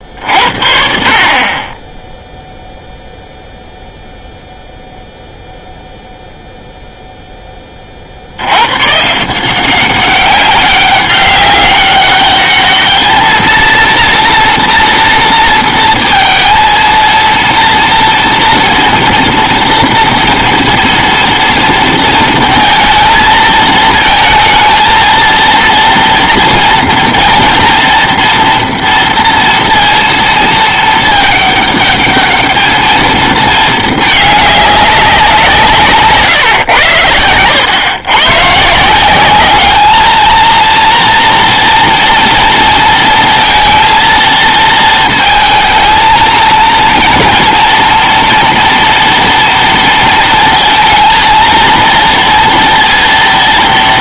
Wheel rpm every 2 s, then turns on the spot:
50, 0, 0, 0, 90, 190, 210, 230, 230, 230, 230, 230, 220, 230, 230, 230, 210, 210, 130, 140, 230, 230, 220, 230, 230, 230, 230.
none